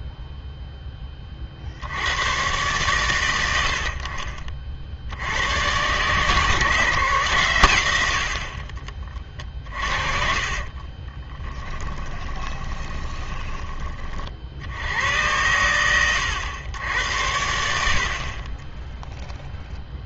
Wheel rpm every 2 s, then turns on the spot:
10, 120, 50, 150, 30, 30, 20, 80, 100, 20.
10-14